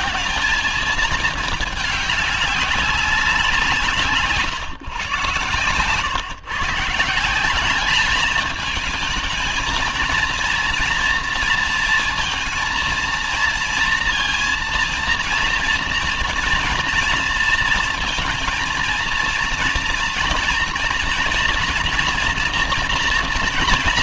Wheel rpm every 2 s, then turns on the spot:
220, 200, 130, 140, 210, 230, 230, 230, 230, 230, 230, 230.
none